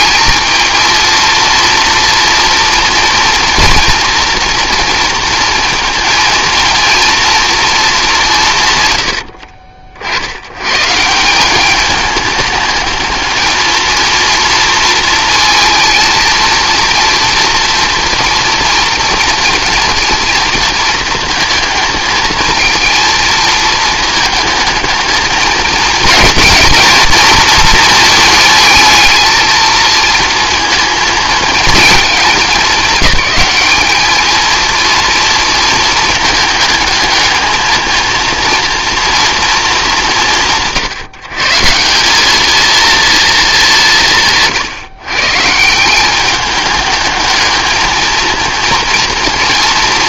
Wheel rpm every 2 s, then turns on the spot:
220, 230, 230, 230, 130, 130, 210, 230, 230, 230, 230, 230, 220, 230, 220, 230, 210, 230, 220, 230, 150, 220, 150, 210, 230.
none